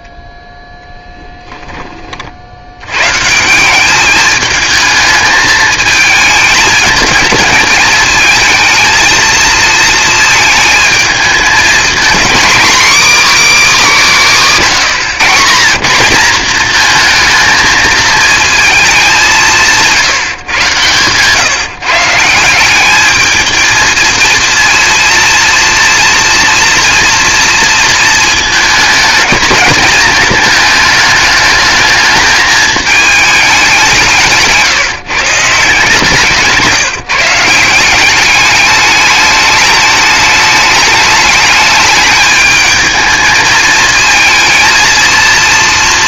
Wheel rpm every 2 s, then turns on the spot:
0, 80, 210, 220, 220, 220, 270, 180, 220, 220, 130, 170, 230, 230, 220, 220, 210, 160, 160, 200, 210, 220, 230.
none